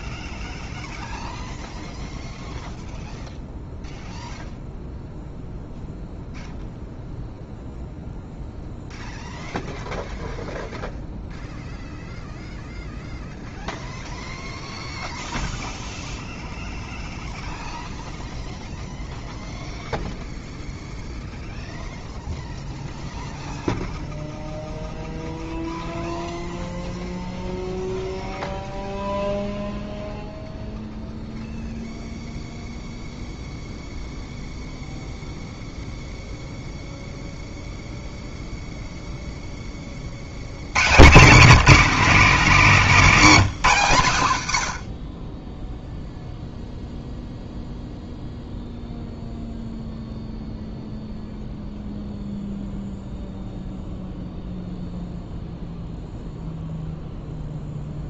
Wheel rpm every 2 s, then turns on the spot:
0, 0, 0, 0, 0, 0, 0, 0, 0, 0, 0, 0, 0, 0, 0, 0, 0, 0, 0, 0, 130, 200, 80, 0, 0, 0, 0, 0, 0.
none